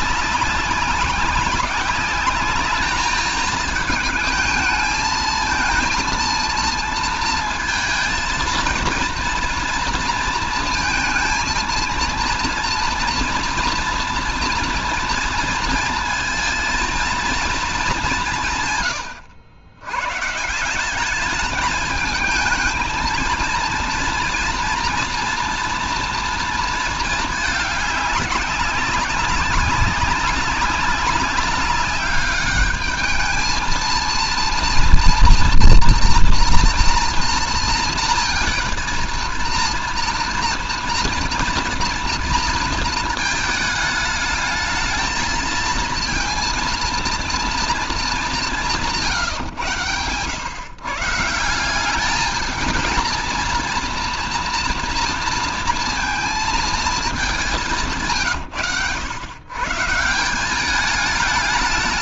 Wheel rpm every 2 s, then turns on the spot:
190, 210, 220, 230, 230, 230, 230, 230, 230, 150, 170, 220, 230, 220, 200, 190, 210, 230, 240, 230, 230, 230, 220, 230, 170, 130, 220, 230, 210, 100, 200.
none